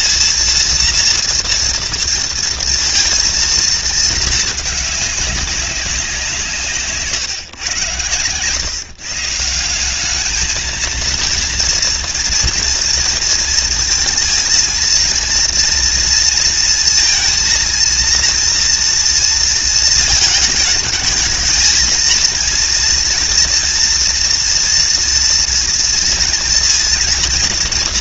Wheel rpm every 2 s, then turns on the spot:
230, 230, 210, 140, 150, 230, 230, 230, 220, 230, 220, 230, 230, 230.
none